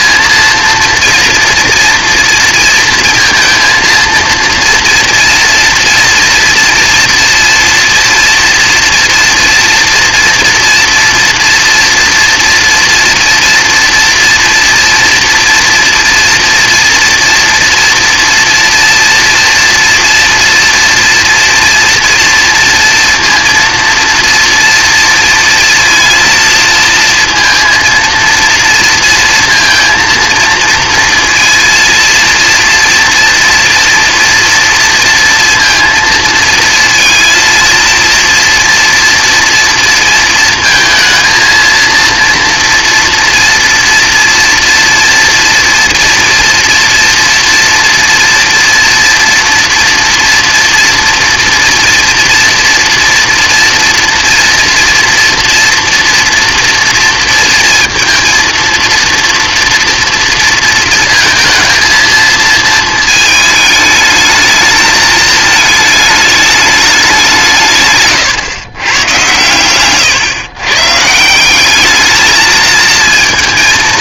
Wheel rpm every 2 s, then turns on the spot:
230, 230, 230, 240, 230, 240, 230, 240, 230, 230, 230, 230, 230, 230, 230, 230, 230, 230, 230, 230, 230, 230, 230, 230, 230, 230, 240, 230, 230, 230, 230, 220, 220, 210, 120, 120, 220.
none